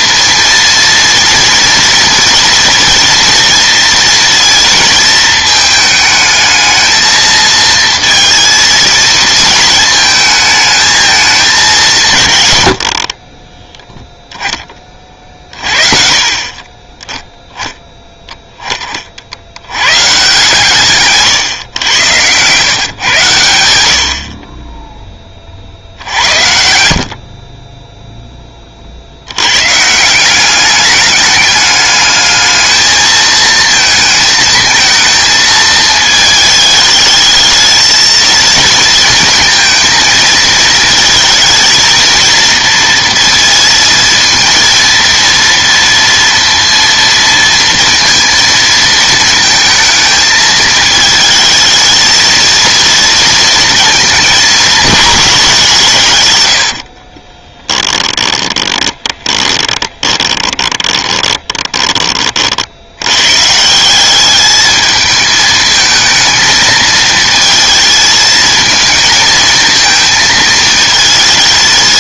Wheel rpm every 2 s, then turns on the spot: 230, 230, 230, 220, 230, 220, 90, 20, 30, 20, 140, 130, 20, 70, 30, 200, 220, 220, 220, 230, 220, 230, 230, 230, 230, 220, 230, 220, 70, 20, 20, 80, 210, 220, 220, 220.
16-18 56-62